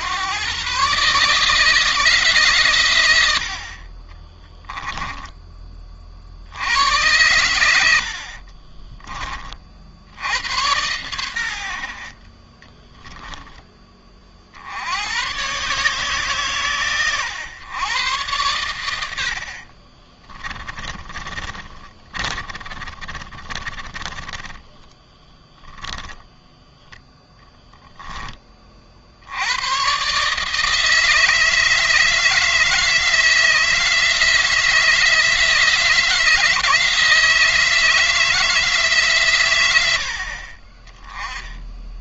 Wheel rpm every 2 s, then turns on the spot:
130, 110, 10, 90, 30, 100, 10, 90, 130, 90, 20, 30, 10, 10, 60, 160, 160, 160, 160, 130, 20.
20-26